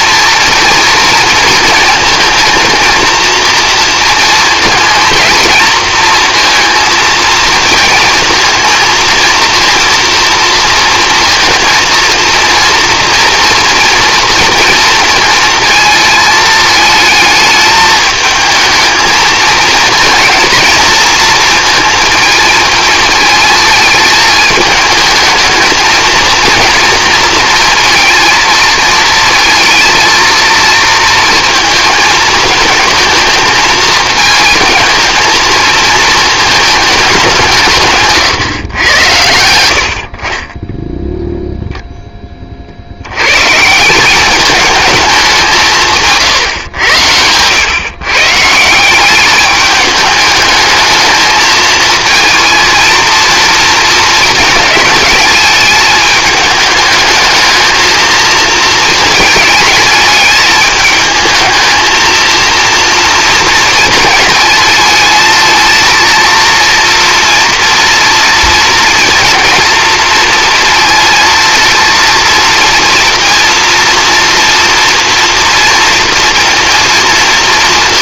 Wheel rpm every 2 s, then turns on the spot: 230, 230, 230, 230, 230, 230, 230, 230, 220, 220, 230, 220, 220, 230, 220, 230, 220, 220, 210, 110, 10, 70, 210, 110, 170, 220, 230, 210, 210, 220, 220, 230, 220, 230, 230, 220, 230, 230, 230.
none